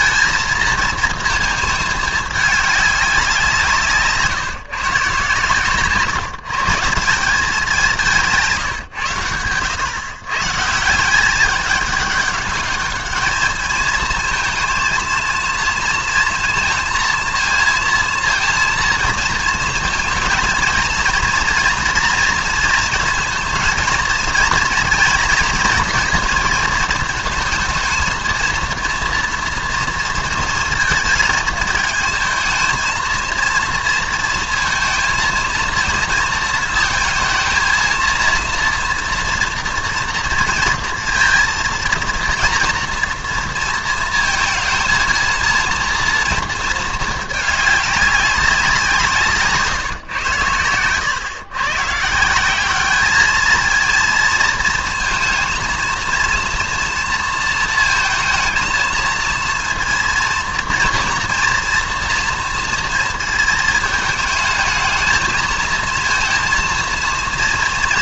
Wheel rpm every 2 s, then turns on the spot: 230, 200, 140, 170, 130, 170, 210, 230, 230, 230, 230, 230, 230, 230, 230, 230, 230, 230, 230, 230, 230, 230, 230, 220, 180, 110, 210, 230, 230, 220, 230, 230, 220, 230.
none